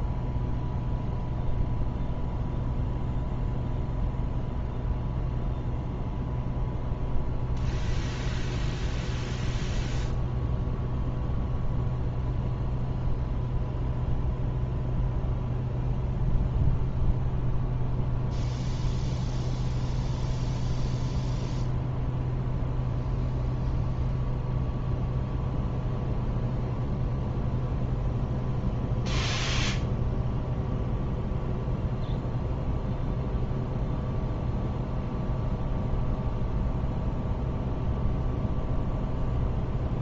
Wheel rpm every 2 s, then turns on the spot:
0, 0, 0, 0, 0, 0, 0, 0, 0, 0, 0, 0, 0, 0, 0, 0, 0, 0, 0, 0.
none